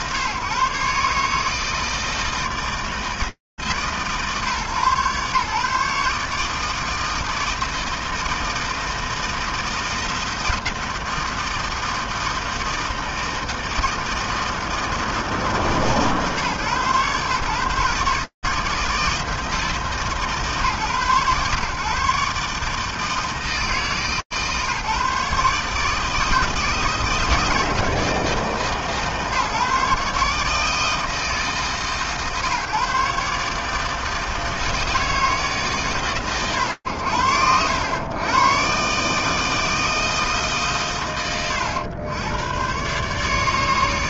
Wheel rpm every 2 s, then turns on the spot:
140, 160, 140, 150, 160, 170, 160, 160, 150, 160, 140, 150, 150, 160, 150, 150, 150, 160, 100, 120, 130, 120.
none